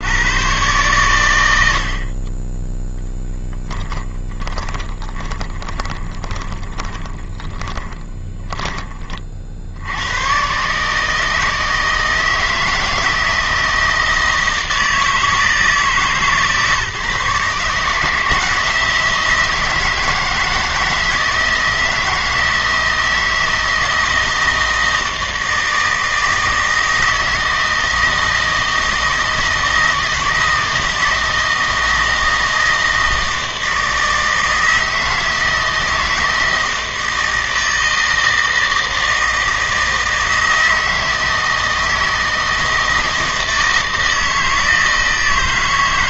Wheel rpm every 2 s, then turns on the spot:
120, 10, 20, 20, 10, 130, 160, 160, 140, 160, 170, 160, 160, 160, 160, 160, 160, 160, 160, 160, 160, 160, 160.
4-8